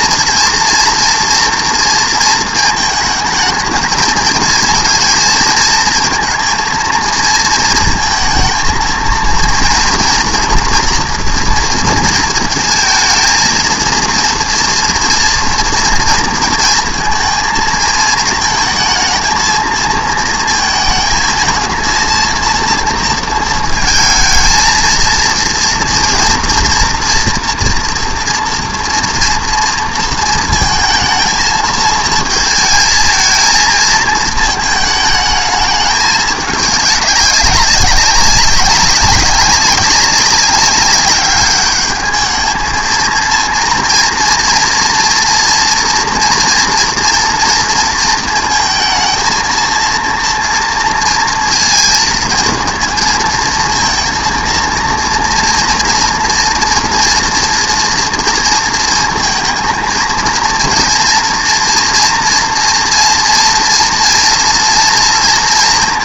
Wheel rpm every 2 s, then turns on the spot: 240, 220, 230, 230, 230, 240, 220, 230, 230, 220, 220, 230, 230, 230, 230, 220, 220, 220, 210, 200, 200, 220, 230, 230, 230, 230, 230, 230, 230, 230, 230, 230, 230.
none